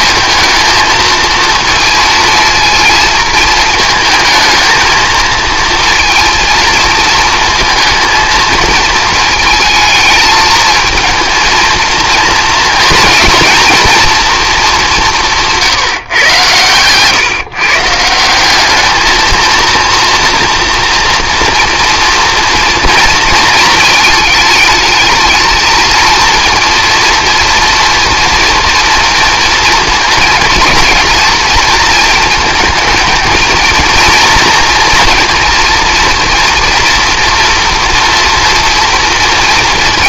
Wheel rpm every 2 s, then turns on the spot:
230, 230, 220, 220, 220, 230, 240, 210, 120, 200, 230, 230, 220, 230, 230, 230, 230, 240, 240, 230.
none